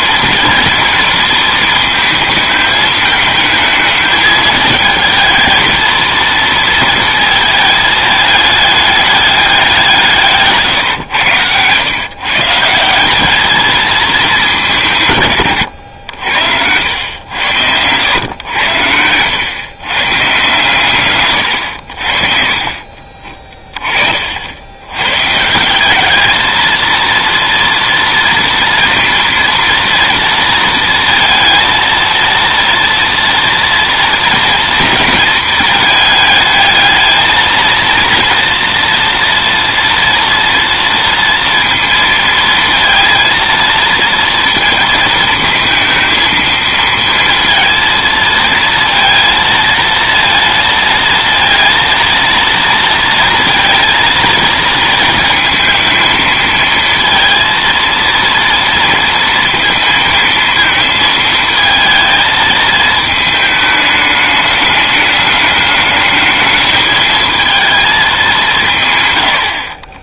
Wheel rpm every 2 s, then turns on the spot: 230, 220, 220, 230, 210, 150, 150, 180, 80, 100, 140, 40, 80, 220, 230, 230, 230, 240, 220, 230, 230, 230, 230, 220, 230, 230, 230, 230, 220, 230, 230, 220, 210, 210, 180.
10-12